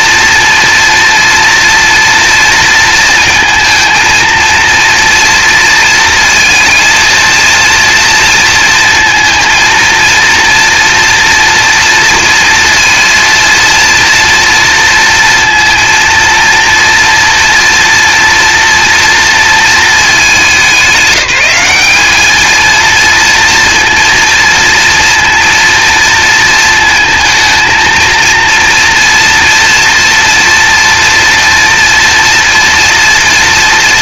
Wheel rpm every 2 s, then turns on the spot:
230, 230, 230, 230, 230, 230, 230, 230, 230, 230, 200, 230, 230, 230, 230, 240, 230.
none